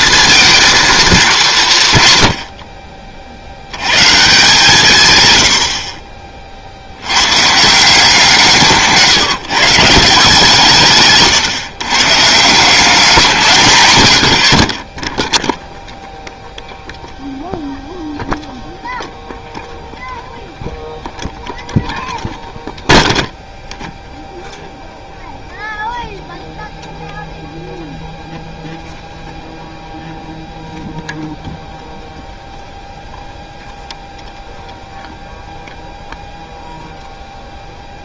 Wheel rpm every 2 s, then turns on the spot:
230, 60, 140, 60, 160, 150, 170, 40, 0, 0, 0, 0, 0, 0, 0, 0, 0, 0, 0.
none